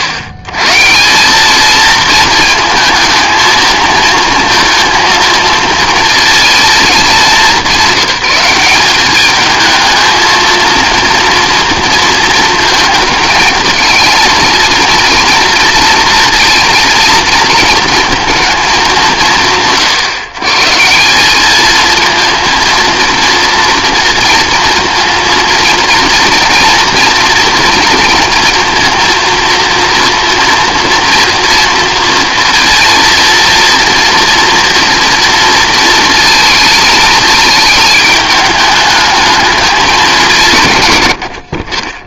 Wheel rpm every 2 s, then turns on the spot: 120, 230, 230, 210, 190, 230, 230, 220, 230, 180, 150, 230, 230, 230, 230, 230, 230, 230, 230, 210, 100.
none